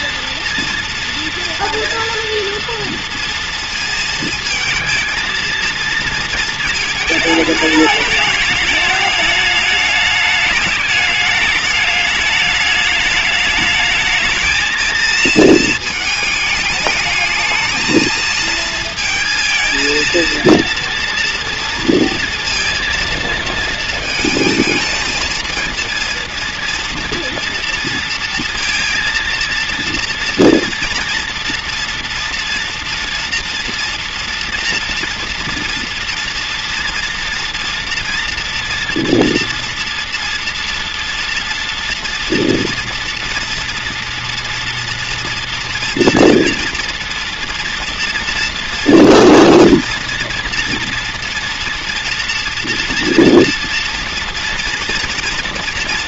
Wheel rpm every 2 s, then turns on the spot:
230, 230, 220, 220, 210, 210, 210, 220, 210, 230, 230, 230, 220, 230, 230, 230, 230, 230, 230, 240, 230, 230, 240, 240, 230, 230, 230, 240.
none